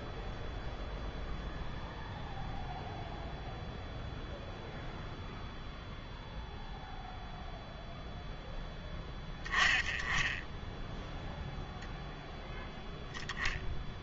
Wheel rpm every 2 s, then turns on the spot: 0, 0, 0, 0, 10, 10, 0.
none